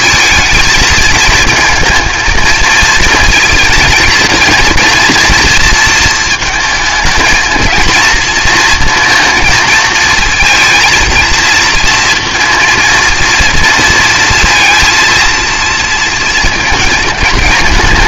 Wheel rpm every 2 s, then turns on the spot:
230, 220, 220, 220, 230, 230, 230, 230, 230.
none